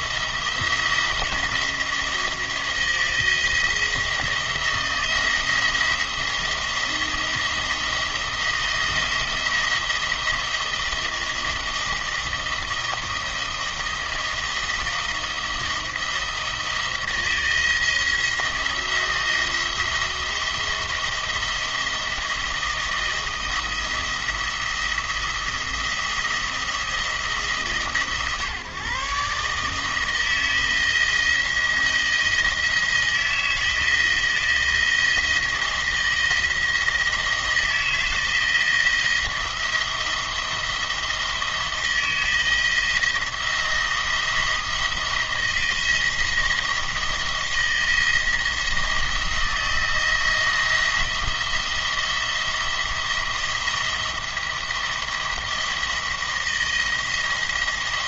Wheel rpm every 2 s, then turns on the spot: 170, 170, 160, 170, 160, 170, 170, 160, 160, 170, 170, 160, 170, 170, 140, 170, 170, 170, 170, 170, 170, 160, 160, 170, 170, 170, 170, 170, 160.
none